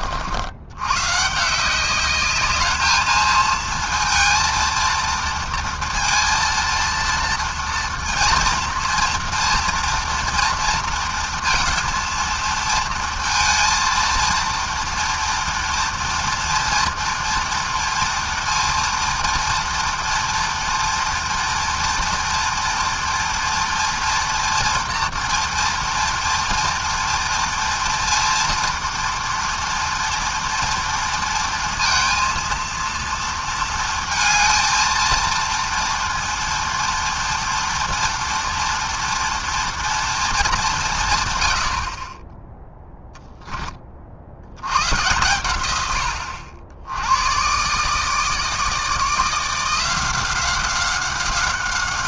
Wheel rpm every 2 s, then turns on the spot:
90, 210, 230, 230, 230, 230, 230, 230, 230, 230, 230, 230, 230, 230, 230, 230, 230, 230, 230, 230, 210, 10, 90, 80, 160, 180.
none